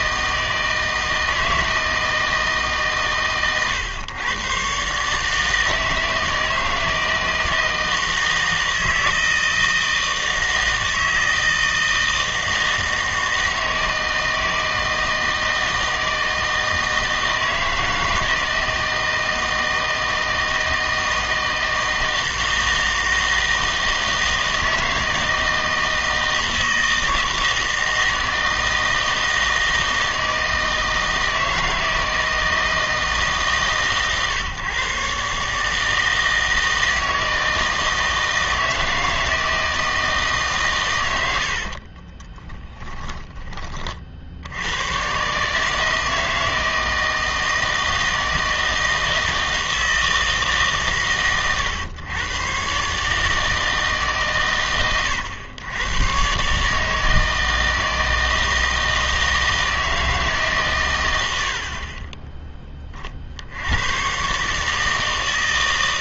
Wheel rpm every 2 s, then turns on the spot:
160, 150, 130, 160, 160, 160, 160, 160, 160, 160, 160, 160, 160, 160, 160, 160, 160, 130, 160, 160, 140, 20, 90, 160, 160, 140, 140, 120, 150, 160, 130, 20, 150.
42-44